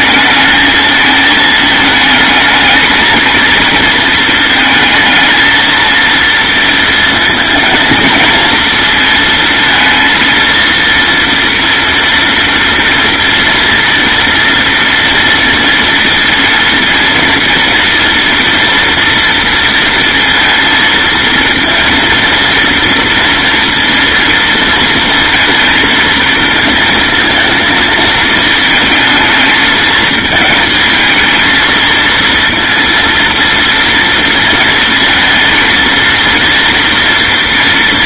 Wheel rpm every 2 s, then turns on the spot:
220, 220, 230, 230, 230, 230, 230, 230, 230, 230, 230, 230, 230, 230, 220, 220, 230, 220, 230.
none